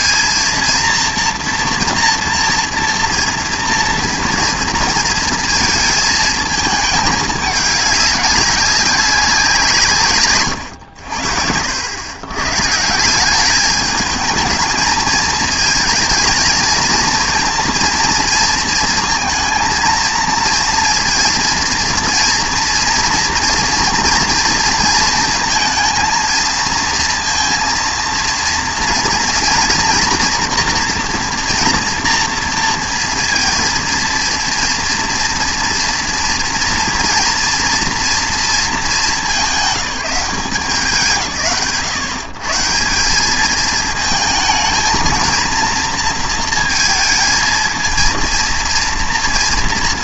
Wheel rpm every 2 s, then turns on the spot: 230, 230, 230, 220, 200, 110, 140, 210, 230, 230, 230, 230, 230, 230, 230, 240, 230, 230, 230, 220, 170, 150, 230, 230, 230.
none